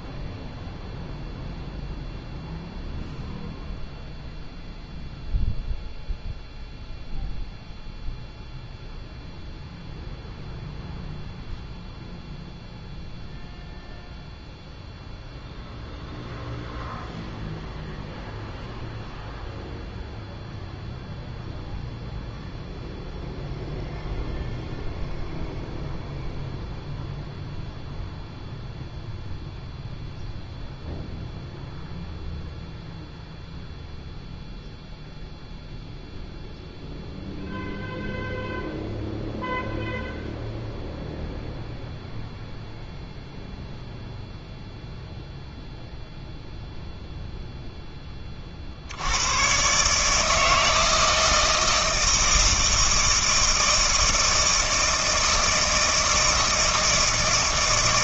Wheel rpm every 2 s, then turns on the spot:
0, 0, 0, 0, 0, 0, 0, 0, 0, 0, 0, 0, 0, 0, 0, 0, 0, 0, 0, 0, 0, 0, 0, 0, 60, 160, 160, 160, 160.
none